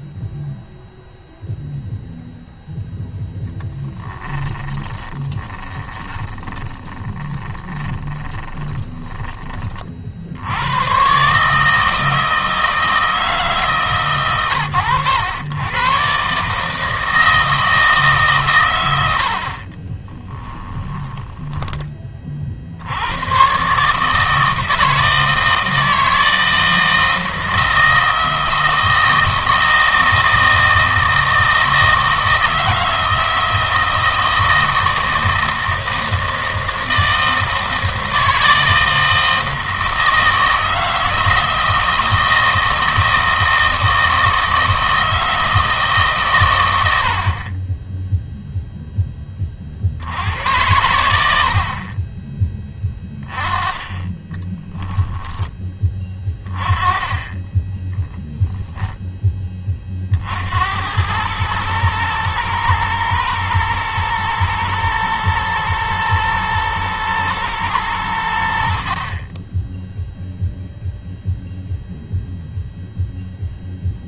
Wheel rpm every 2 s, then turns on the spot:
0, 0, 20, 20, 20, 100, 160, 110, 150, 120, 20, 60, 160, 160, 160, 160, 160, 160, 160, 160, 160, 160, 160, 110, 0, 90, 20, 10, 20, 0, 80, 110, 110, 110, 60, 0, 0.
4-10 20-22 54-56